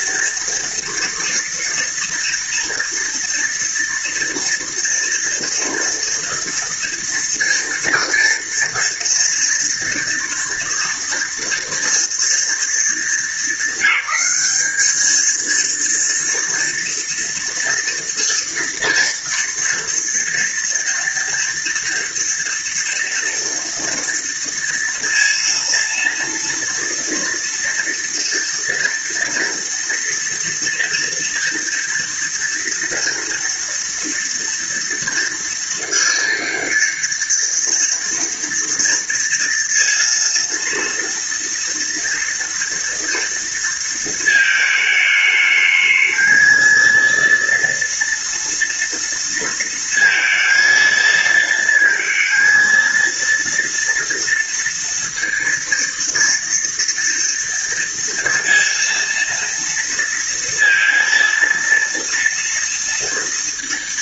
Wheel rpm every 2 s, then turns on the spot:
230, 230, 230, 230, 230, 230, 230, 210, 230, 230, 240, 230, 230, 230, 240, 230, 230, 230, 230, 240, 230, 230, 220, 220, 230, 230, 230, 230, 230, 230, 230, 230.
none